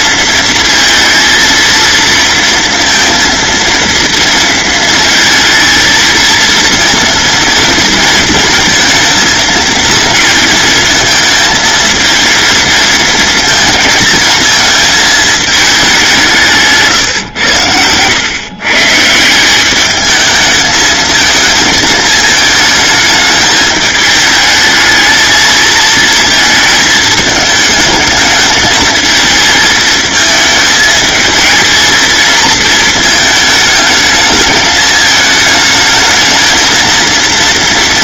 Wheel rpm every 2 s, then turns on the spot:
230, 230, 230, 230, 220, 220, 230, 220, 150, 160, 220, 220, 220, 220, 220, 220, 220, 220, 220.
none